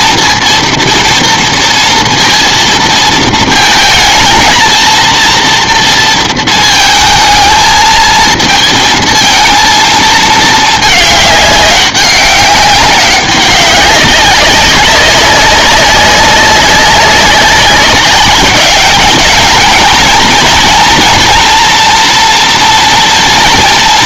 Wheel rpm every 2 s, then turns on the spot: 230, 230, 230, 220, 220, 220, 200, 190, 190, 210, 230, 230.
none